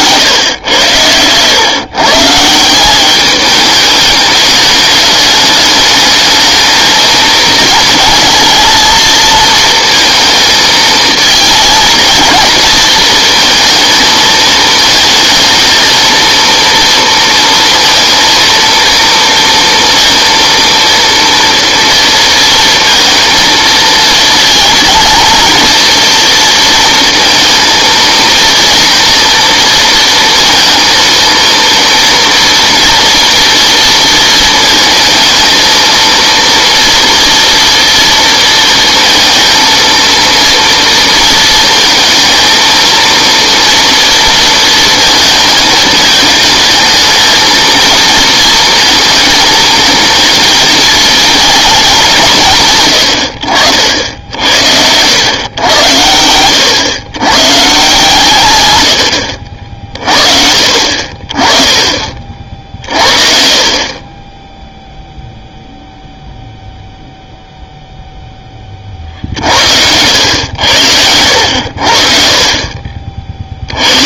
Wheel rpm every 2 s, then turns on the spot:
100, 180, 210, 220, 230, 220, 230, 220, 230, 230, 230, 230, 230, 230, 230, 230, 230, 230, 230, 230, 230, 230, 230, 220, 230, 220, 150, 70, 100, 100, 50, 50, 10, 0, 30, 90, 40.
none